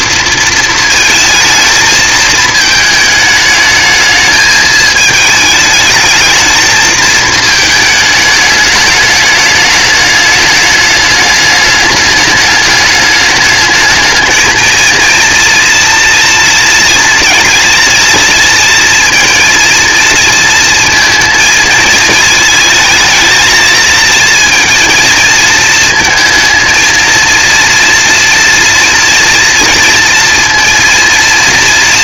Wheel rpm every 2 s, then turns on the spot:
220, 220, 210, 220, 210, 210, 210, 230, 230, 230, 230, 230, 230, 230, 230, 230.
none